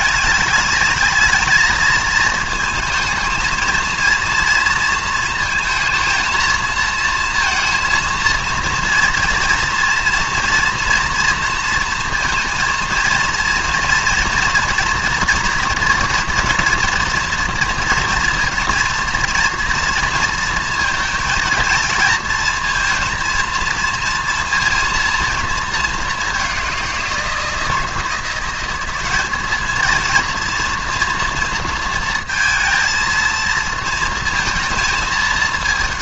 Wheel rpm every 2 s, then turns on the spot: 210, 220, 230, 230, 230, 230, 230, 230, 230, 230, 230, 230, 230, 190, 190, 230, 230, 220.
none